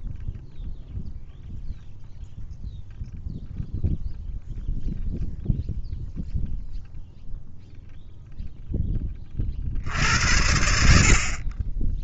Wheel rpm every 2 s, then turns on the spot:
0, 0, 0, 0, 0, 70.
none